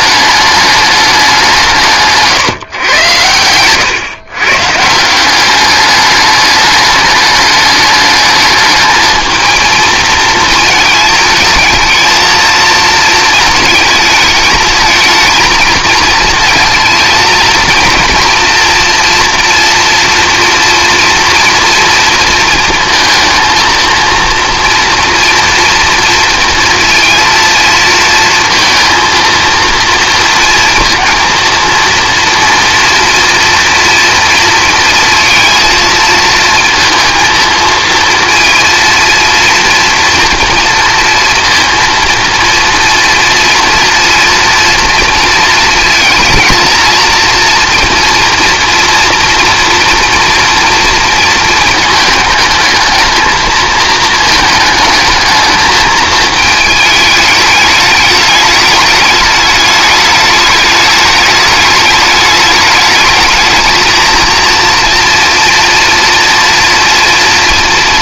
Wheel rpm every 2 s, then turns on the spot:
210, 120, 140, 210, 210, 220, 220, 220, 220, 240, 230, 230, 230, 230, 230, 230, 230, 230, 230, 230, 230, 230, 230, 230, 230, 230, 220, 220, 210, 210, 210, 210, 230, 230.
none